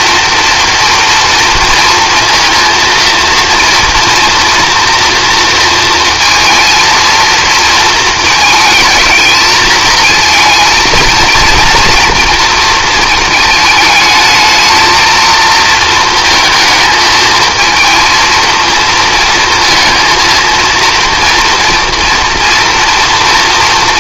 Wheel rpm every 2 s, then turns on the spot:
230, 230, 230, 230, 220, 230, 230, 220, 220, 220, 230, 230.
none